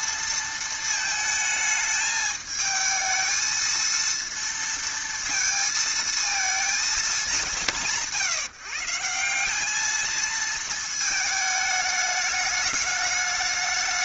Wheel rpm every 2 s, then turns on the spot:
230, 220, 230, 220, 170, 220, 200.
none